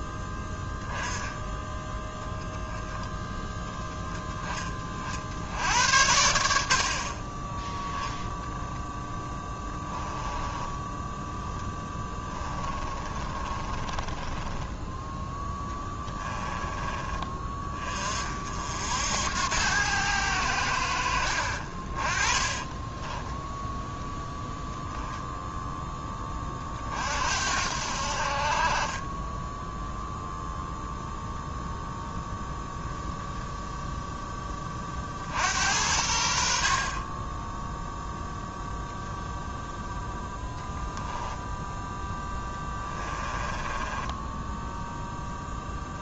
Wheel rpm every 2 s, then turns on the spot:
10, 10, 50, 50, 10, 20, 30, 10, 20, 70, 80, 20, 0, 50, 30, 0, 10, 40, 30, 0, 10, 20, 0.
8-14 22-24 42-44